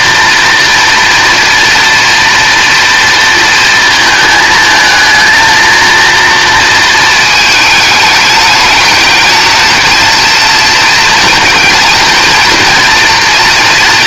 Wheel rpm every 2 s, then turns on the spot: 230, 230, 220, 220, 210, 230, 230.
none